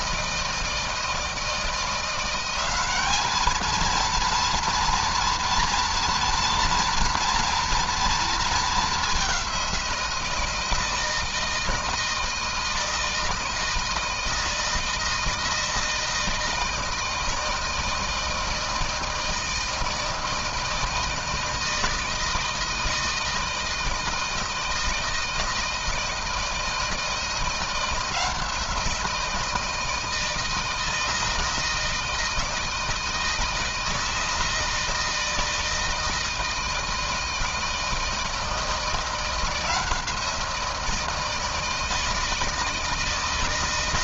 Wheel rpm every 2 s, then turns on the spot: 160, 190, 230, 230, 220, 170, 160, 160, 160, 160, 160, 160, 160, 160, 170, 160, 160, 160, 160, 160, 170, 160.
none